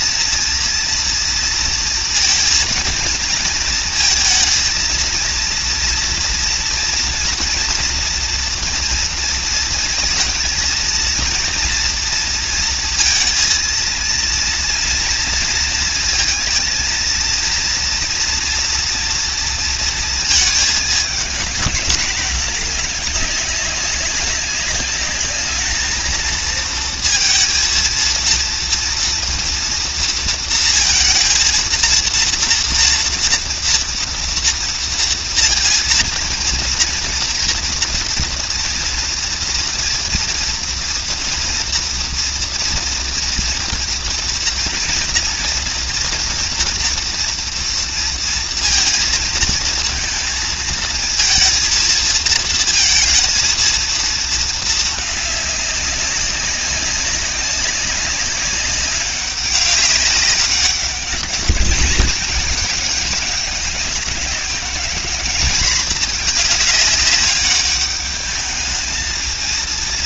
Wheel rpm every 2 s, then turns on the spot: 230, 230, 230, 230, 230, 230, 230, 230, 230, 230, 220, 210, 210, 230, 230, 230, 230, 230, 230, 230, 230, 230, 240, 230, 230, 220, 220, 210, 200, 200, 200, 210, 200, 210, 210.
none